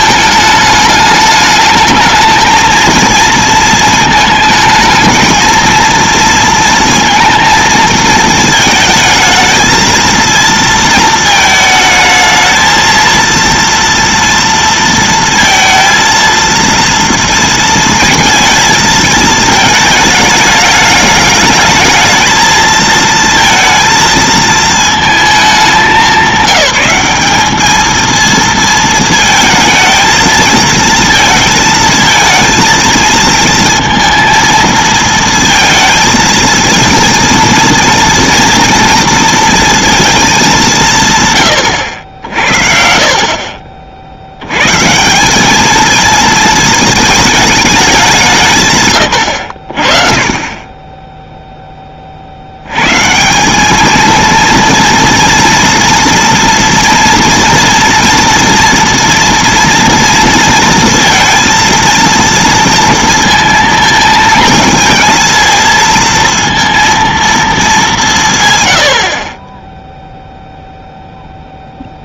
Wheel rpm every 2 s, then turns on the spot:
220, 220, 230, 220, 230, 220, 230, 230, 230, 210, 220, 230, 190, 230, 220, 220, 230, 230, 230, 210, 70, 60, 220, 190, 40, 20, 220, 230, 230, 230, 230, 220, 230, 190, 0, 0.
none